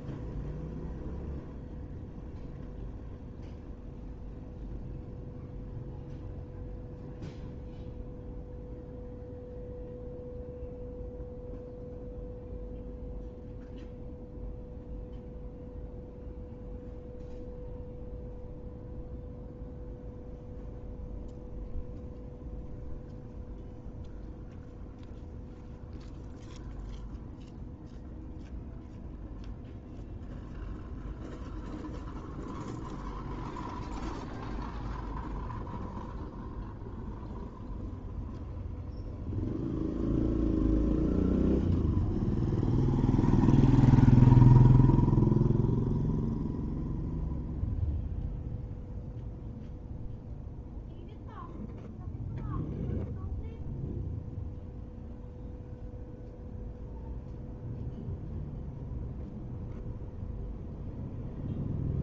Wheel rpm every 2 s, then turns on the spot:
0, 0, 0, 0, 0, 0, 0, 0, 0, 0, 0, 0, 0, 0, 0, 0, 0, 0, 0, 0, 0, 0, 0, 0, 0, 0, 0, 0, 0, 0, 0.
none